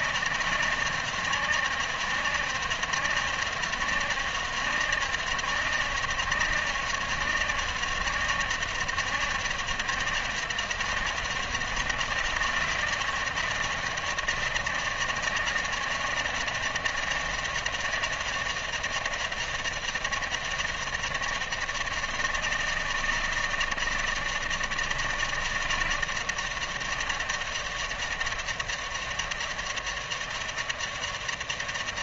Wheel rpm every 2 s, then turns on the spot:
160, 160, 160, 160, 160, 160, 160, 160, 160, 150, 150, 160, 160, 150, 150, 150.
none